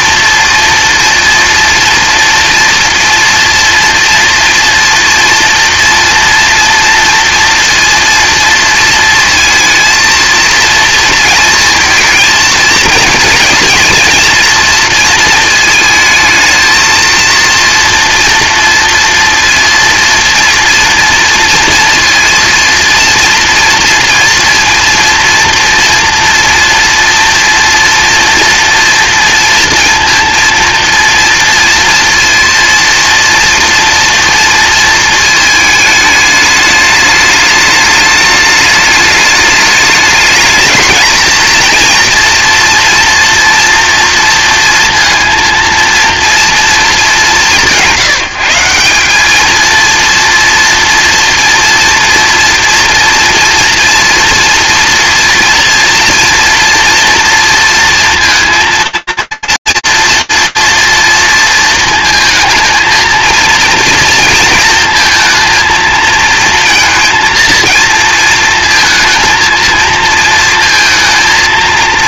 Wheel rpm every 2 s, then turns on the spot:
230, 230, 230, 230, 230, 230, 220, 230, 230, 230, 230, 230, 230, 230, 230, 230, 230, 230, 210, 210, 220, 230, 230, 220, 170, 230, 230, 230, 230, 230, 230, 220, 230, 230, 220, 220.
none